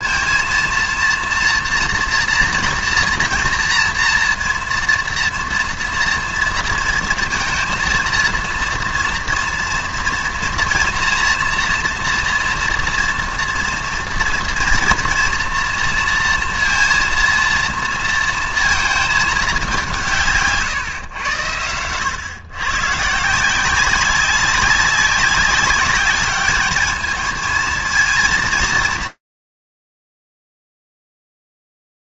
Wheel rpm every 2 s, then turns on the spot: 230, 230, 230, 230, 230, 230, 230, 230, 230, 230, 160, 120, 190, 200, 230, 110.
none